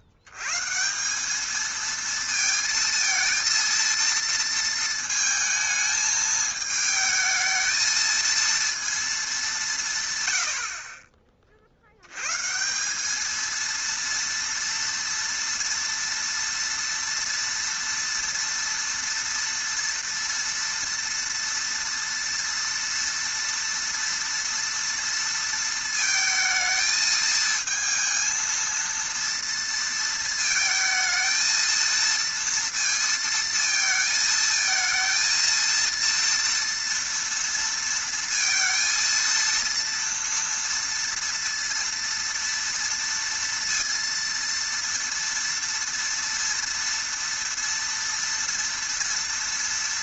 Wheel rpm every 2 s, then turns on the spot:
80, 230, 230, 220, 230, 90, 140, 230, 230, 230, 230, 230, 230, 220, 230, 220, 230, 220, 230, 230, 230, 230, 230, 230, 240.
none